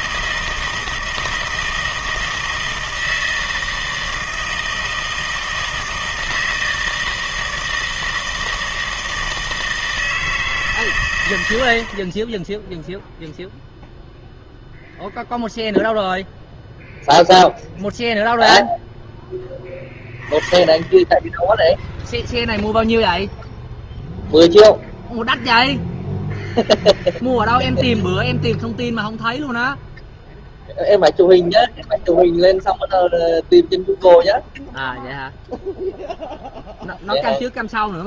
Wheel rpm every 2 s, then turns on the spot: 160, 160, 160, 160, 160, 140, 0, 0, 0, 0, 10, 0, 0, 0, 0, 0, 0, 0, 0.
none